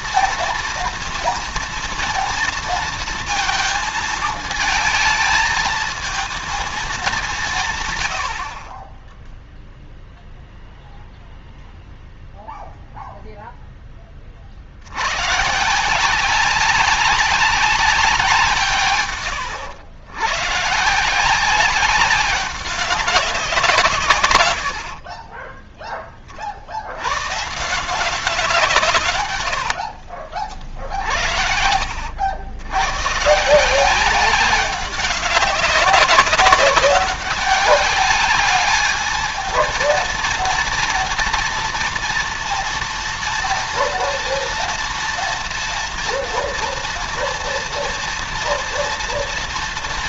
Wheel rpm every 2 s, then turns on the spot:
230, 230, 220, 220, 50, 0, 0, 50, 190, 160, 120, 190, 90, 40, 170, 60, 90, 190, 190, 210, 230, 230, 240, 240, 230.
30-32